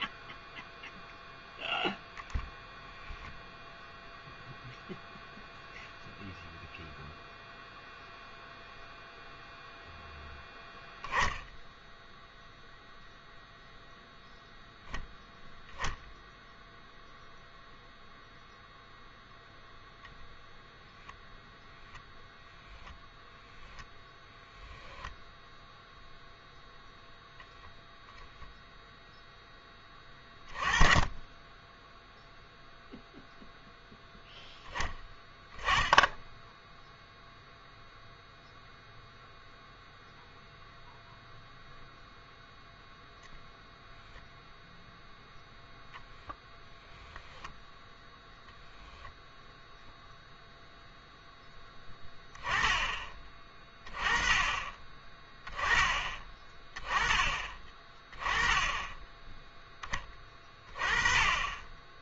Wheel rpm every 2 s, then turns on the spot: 0, 0, 0, 0, 0, 0, 0, 0, 0, 0, 0, 0, 0, 0, 0, 20, 0, 10, 10, 0, 0, 0, 0, 0, 0, 0, 20, 20, 20, 10, 20.
none